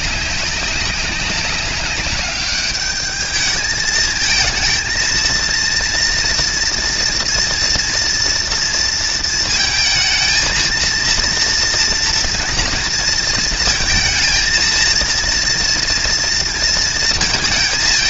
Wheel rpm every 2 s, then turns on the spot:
200, 210, 220, 230, 230, 220, 230, 220, 230.
none